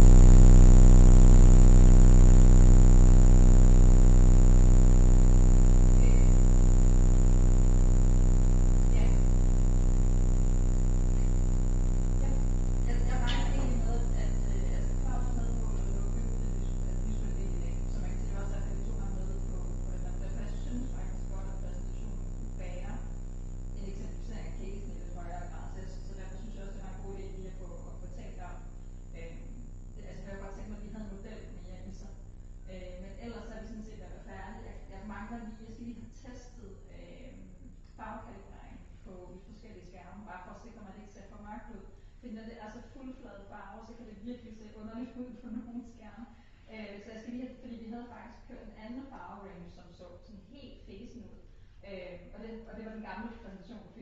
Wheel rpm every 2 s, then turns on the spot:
0, 0, 0, 0, 0, 0, 0, 0, 0, 0, 0, 0, 0, 0, 0, 0, 0, 0, 0, 0, 0, 0, 0, 0, 0, 0, 0.
none